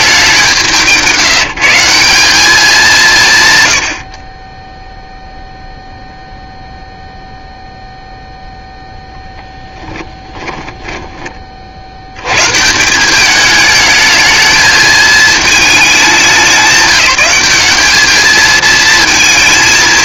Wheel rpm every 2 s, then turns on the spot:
190, 190, 30, 0, 0, 10, 140, 220, 200, 220.
10-12